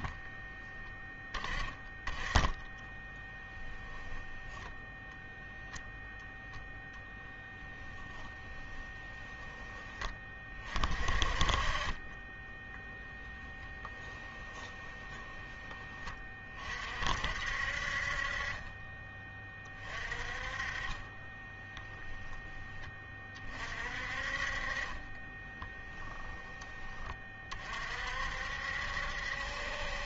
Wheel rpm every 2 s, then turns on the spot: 10, 10, 10, 0, 10, 30, 10, 10, 40, 30, 30, 10, 40, 10, 60.
2-4 8-10 14-16